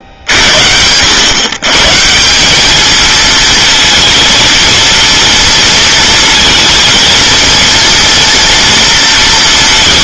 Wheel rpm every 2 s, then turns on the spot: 70, 200, 230, 230, 230.
none